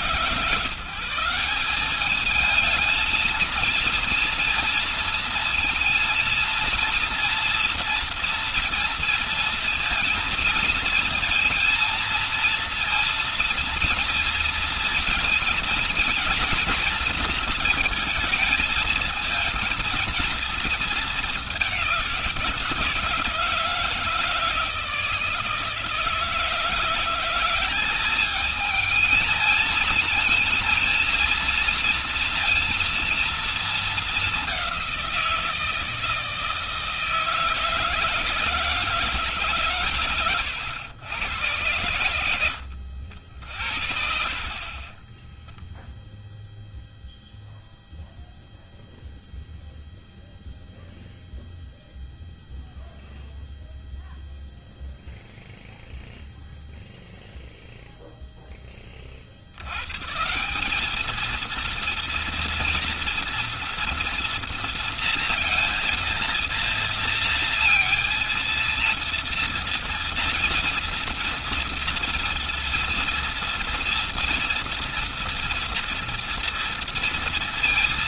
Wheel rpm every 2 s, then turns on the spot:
160, 220, 230, 230, 230, 230, 230, 230, 230, 220, 220, 170, 160, 160, 210, 230, 230, 200, 160, 160, 100, 90, 50, 0, 0, 0, 0, 0, 0, 10, 170, 230, 230, 230, 230, 230, 230, 230, 230.
42-44